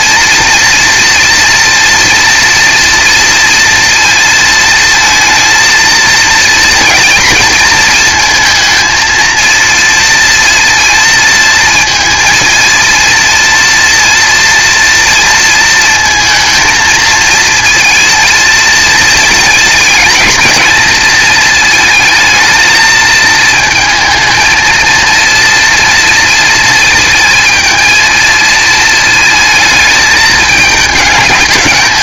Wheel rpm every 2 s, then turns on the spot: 240, 230, 230, 230, 230, 230, 230, 230, 230, 220, 220, 220, 230, 220, 220, 210.
none